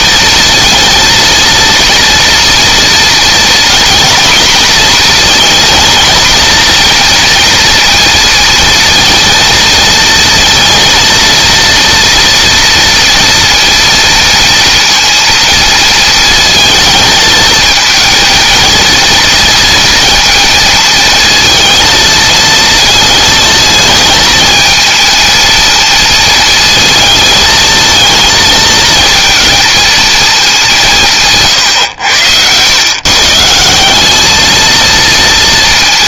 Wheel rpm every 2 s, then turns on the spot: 230, 240, 240, 230, 230, 230, 230, 230, 220, 230, 230, 230, 230, 230, 230, 180, 130, 230.
none